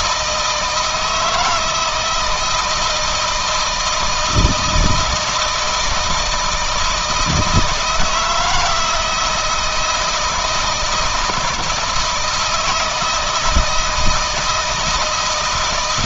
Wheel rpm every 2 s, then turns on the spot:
160, 160, 170, 160, 160, 160, 160, 160.
none